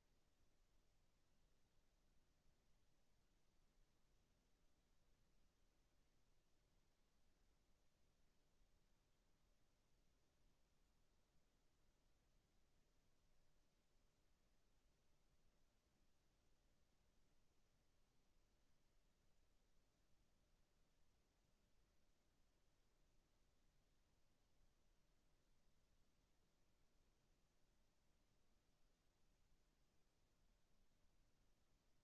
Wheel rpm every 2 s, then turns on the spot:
0, 0, 0, 0, 0, 0, 0, 0, 0, 0, 0, 0, 0, 0, 0, 0.
none